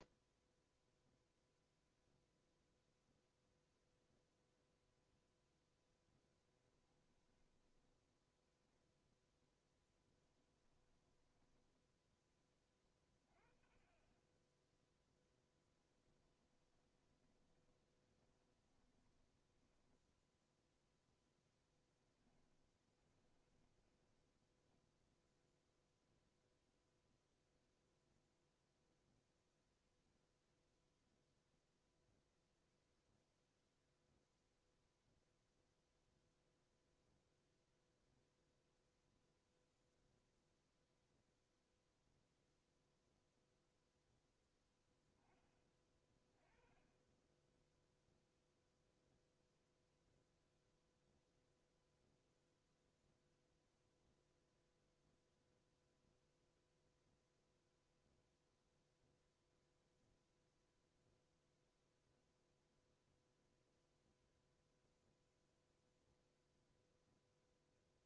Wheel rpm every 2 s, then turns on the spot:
0, 0, 0, 10, 0, 20, 30, 10, 20, 20, 0, 20, 0, 0, 0, 0, 0, 0, 0, 0, 0, 0, 10, 20, 0, 0, 0, 0, 0, 0, 0, 0, 0, 0.
6-8 10-12 16-20 22-24